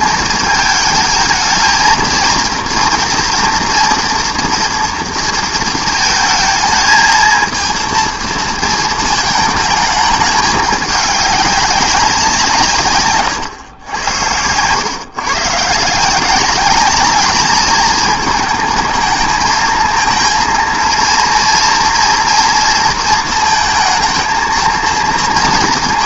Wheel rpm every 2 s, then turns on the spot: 220, 230, 230, 220, 220, 200, 150, 110, 200, 220, 230, 230, 230.
none